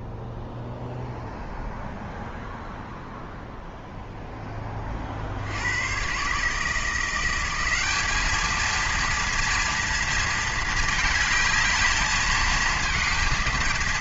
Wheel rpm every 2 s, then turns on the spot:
0, 0, 30, 160, 230, 220, 220.
none